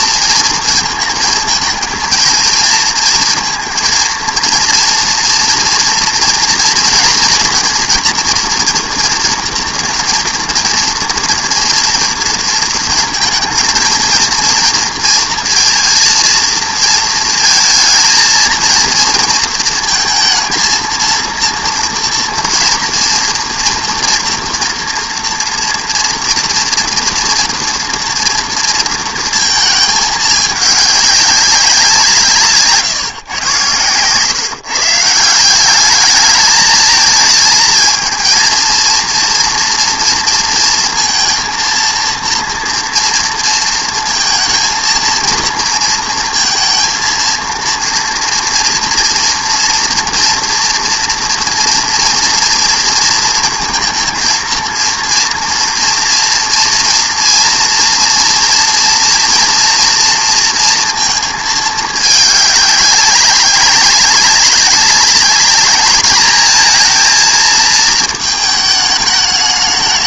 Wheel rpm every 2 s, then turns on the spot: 230, 230, 230, 230, 240, 230, 230, 230, 230, 230, 220, 230, 230, 230, 230, 210, 150, 150, 220, 230, 230, 230, 230, 230, 230, 230, 230, 230, 240, 230, 230, 200, 190, 220, 220.
none